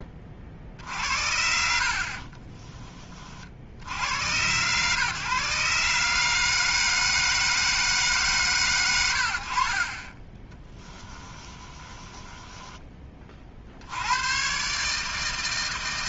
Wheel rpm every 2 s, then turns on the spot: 50, 30, 130, 160, 70, 20, 20, 140.
0-2 10-12